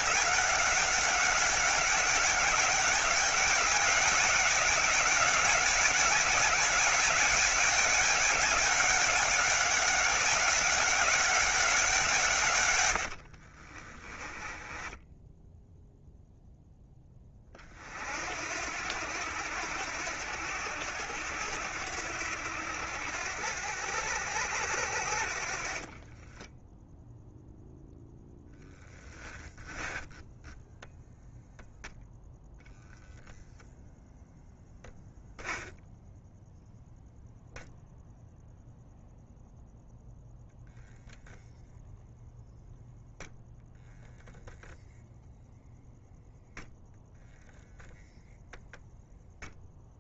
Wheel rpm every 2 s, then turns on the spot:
190, 200, 200, 200, 190, 190, 110, 10, 10, 80, 90, 80, 70, 0, 10, 0, 0, 0, 0, 0, 0, 0, 0, 0, 0.
14-16